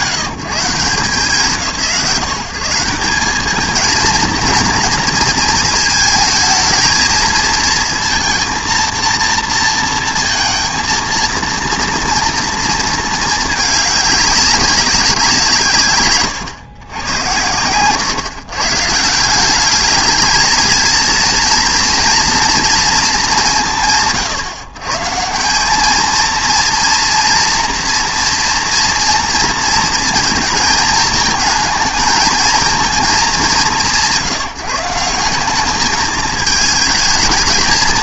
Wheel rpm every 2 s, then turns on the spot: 150, 180, 230, 230, 230, 230, 230, 190, 110, 140, 220, 240, 140, 230, 230, 230, 220, 170, 220.
none